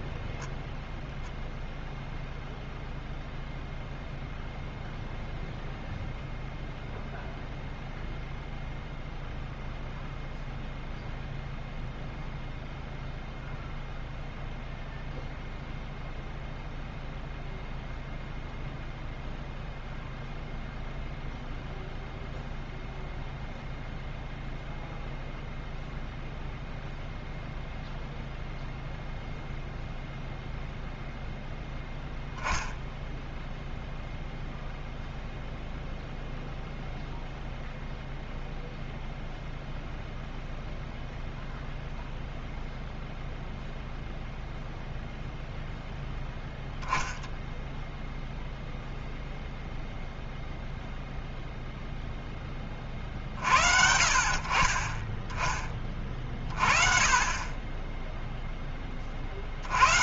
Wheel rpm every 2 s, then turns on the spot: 0, 0, 0, 0, 0, 0, 0, 0, 0, 0, 0, 0, 0, 0, 0, 0, 10, 0, 0, 0, 0, 0, 0, 0, 0, 0, 20, 40, 30, 10.
none